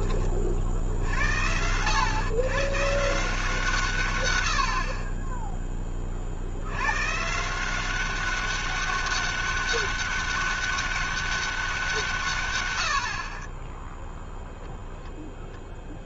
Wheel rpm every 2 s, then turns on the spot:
40, 120, 70, 90, 200, 200, 90, 0.
none